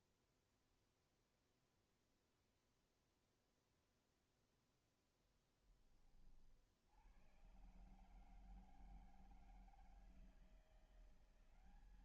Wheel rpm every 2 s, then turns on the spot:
0, 0, 0, 60, 160, 170.
none